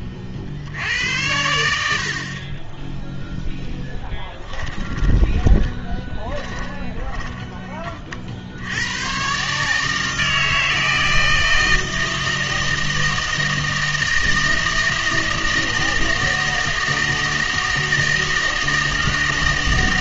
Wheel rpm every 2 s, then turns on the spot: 70, 20, 10, 20, 70, 160, 160, 160, 160, 160.
4-8